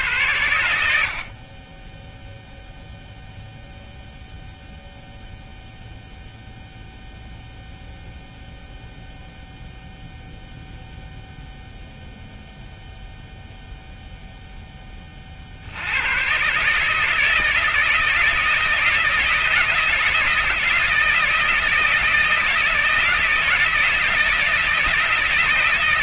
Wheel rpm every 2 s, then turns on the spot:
70, 10, 0, 0, 0, 0, 0, 10, 140, 160, 160, 160, 160.
none